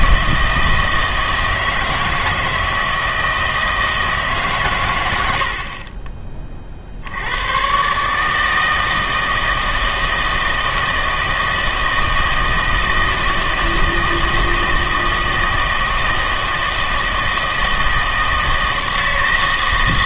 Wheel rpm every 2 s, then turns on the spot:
160, 160, 120, 60, 160, 160, 160, 160, 160, 160.
none